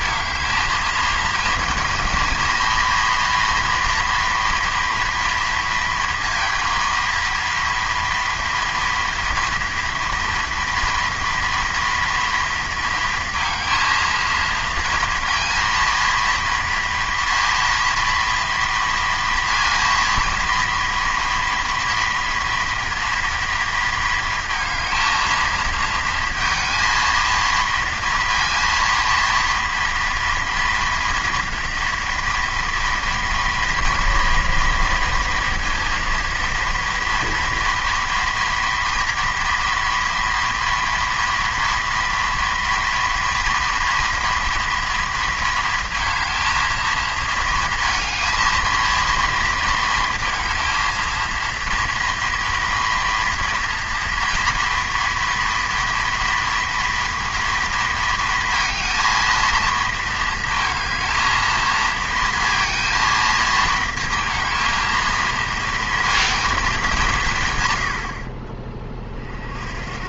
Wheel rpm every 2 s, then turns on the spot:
220, 230, 230, 230, 230, 240, 230, 230, 230, 230, 230, 230, 220, 230, 230, 230, 230, 230, 230, 230, 230, 230, 230, 220, 230, 230, 240, 230, 240, 220, 220, 230, 220, 230, 40.
none